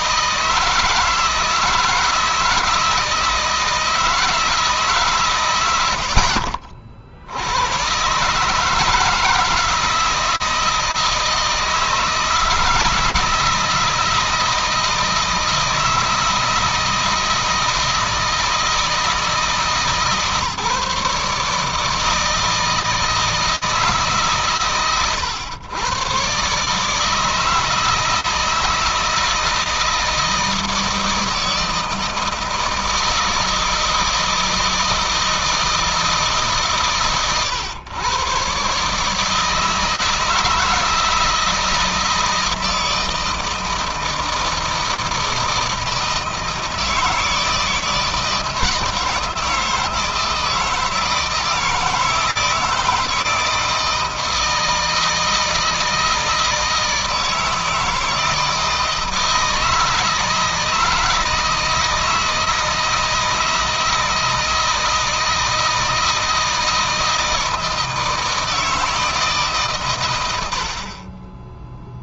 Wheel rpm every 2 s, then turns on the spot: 160, 160, 130, 80, 160, 160, 160, 160, 160, 160, 150, 160, 110, 160, 160, 160, 160, 160, 130, 150, 160, 160, 160, 160, 160, 160, 160, 160, 160, 160, 160, 160, 160, 160, 150, 30.
70-72